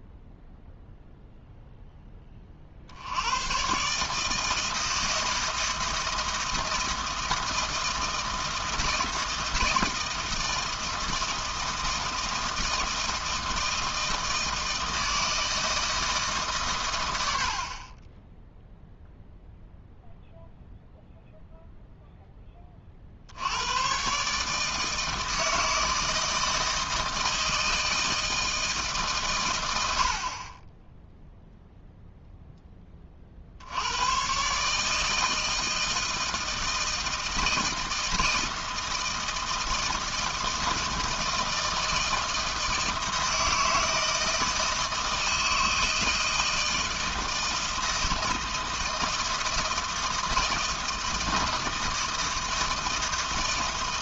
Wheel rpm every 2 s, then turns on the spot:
0, 50, 160, 160, 160, 160, 160, 160, 130, 0, 0, 30, 160, 160, 160, 20, 10, 150, 160, 160, 160, 160, 160, 160, 160, 160, 160.
none